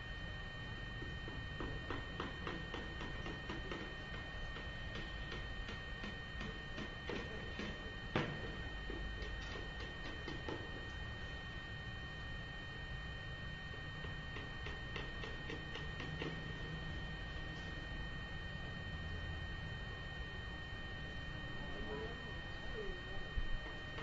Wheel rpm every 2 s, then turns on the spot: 0, 0, 0, 0, 0, 0, 0, 0, 0, 0, 0, 0.
none